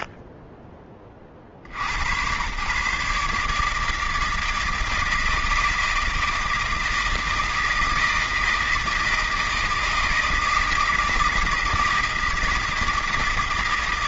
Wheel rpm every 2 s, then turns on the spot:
0, 120, 160, 160, 160, 160, 160.
none